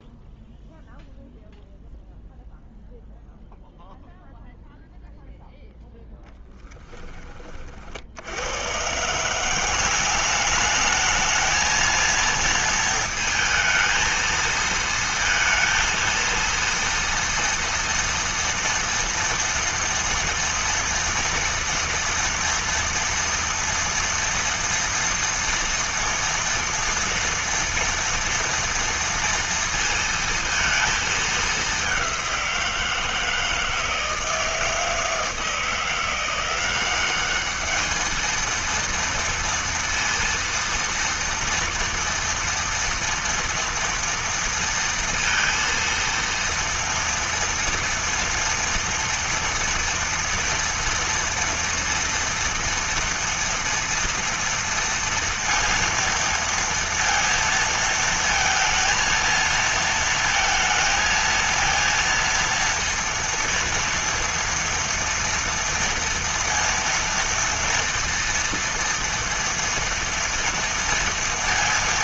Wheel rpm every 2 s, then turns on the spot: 0, 0, 0, 10, 80, 190, 230, 230, 230, 230, 230, 230, 230, 230, 230, 230, 190, 160, 170, 220, 230, 230, 230, 230, 230, 240, 230, 230, 230, 230, 230, 230, 230, 230, 230, 230.
6-8